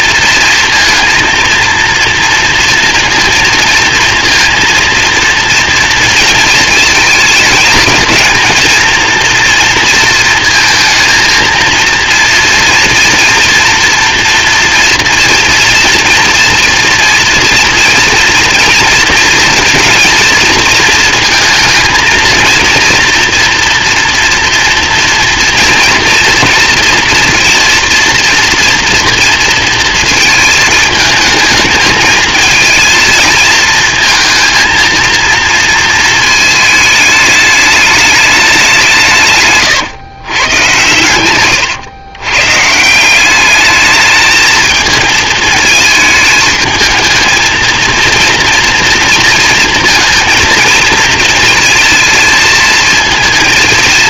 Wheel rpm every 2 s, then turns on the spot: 230, 230, 230, 210, 230, 220, 230, 240, 230, 230, 230, 230, 230, 230, 240, 220, 220, 230, 210, 150, 110, 180, 220, 220, 230, 230, 230.
none